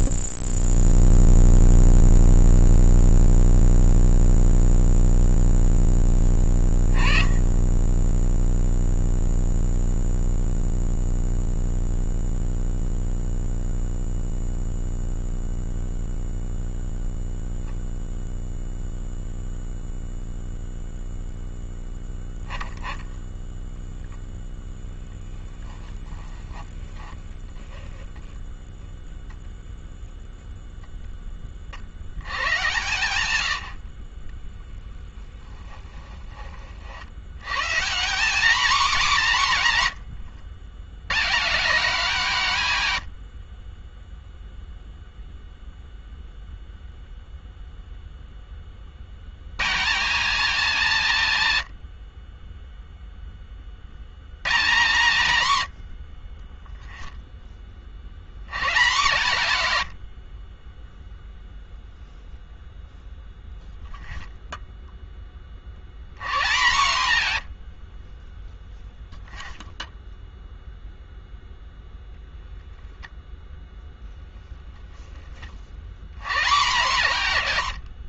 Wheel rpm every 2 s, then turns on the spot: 0, 0, 0, 10, 20, 0, 0, 0, 0, 0, 0, 10, 0, 10, 0, 0, 100, 0, 40, 230, 100, 130, 0, 0, 30, 190, 10, 120, 10, 130, 10, 0, 0, 130, 0, 0, 10, 0, 140.
26-28